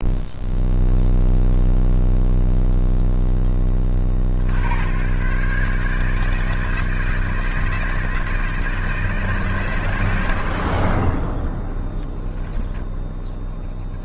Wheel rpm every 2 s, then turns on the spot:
0, 0, 80, 160, 160, 70, 10.
10-14